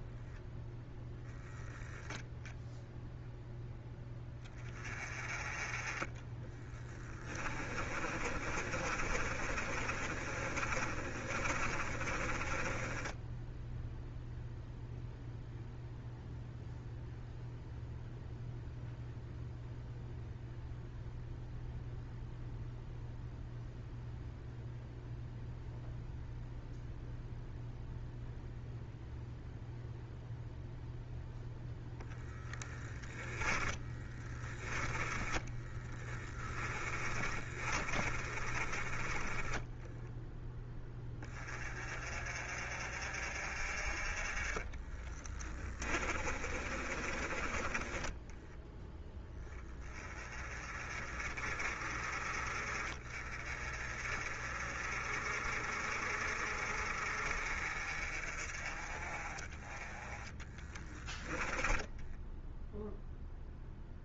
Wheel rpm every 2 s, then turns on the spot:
10, 0, 20, 20, 30, 30, 20, 0, 0, 0, 0, 0, 0, 0, 0, 0, 10, 20, 20, 20, 10, 50, 20, 20, 10, 30, 30, 40, 40, 30, 10, 0.
6-14 32-38 44-48